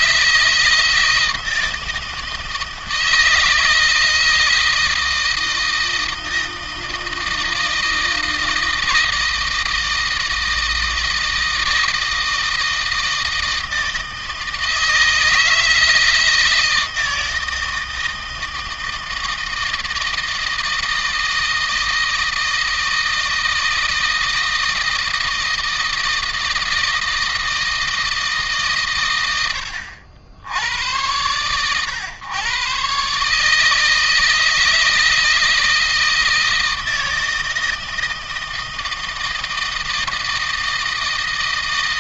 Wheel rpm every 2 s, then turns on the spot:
160, 160, 160, 160, 160, 160, 160, 160, 160, 160, 160, 160, 160, 160, 110, 100, 130, 160, 160, 160, 160.
none